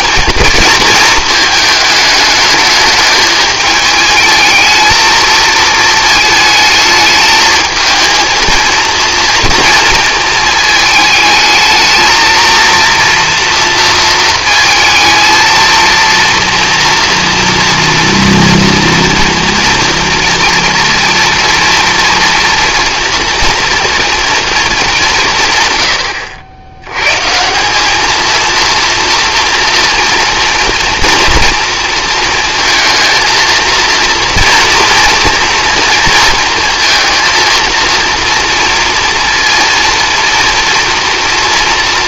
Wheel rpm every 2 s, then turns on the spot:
220, 210, 220, 220, 230, 220, 230, 220, 230, 240, 240, 230, 210, 90, 230, 230, 230, 230, 230, 230, 230.
none